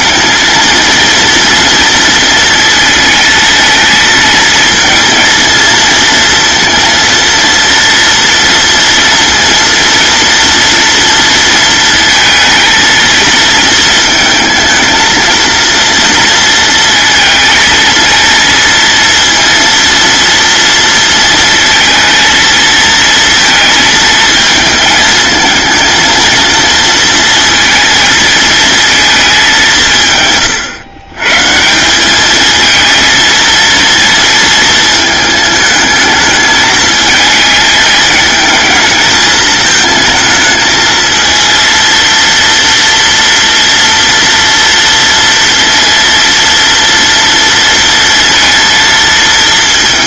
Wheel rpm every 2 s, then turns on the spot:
230, 230, 230, 230, 230, 230, 230, 220, 230, 230, 230, 220, 220, 230, 220, 130, 230, 220, 220, 210, 220, 230, 230, 230, 230.
none